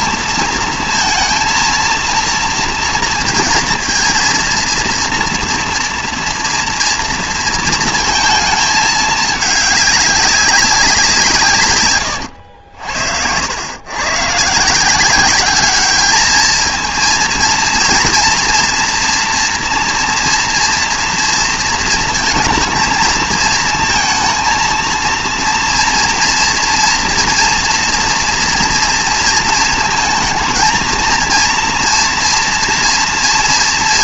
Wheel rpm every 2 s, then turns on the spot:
230, 230, 230, 230, 220, 190, 80, 150, 220, 230, 230, 230, 230, 230, 230, 230, 230.
none